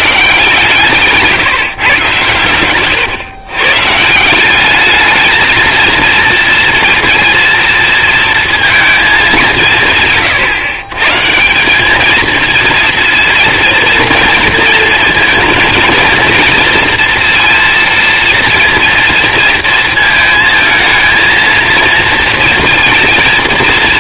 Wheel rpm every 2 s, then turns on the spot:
150, 130, 220, 230, 150, 200, 230, 230, 230, 220, 230, 230.
none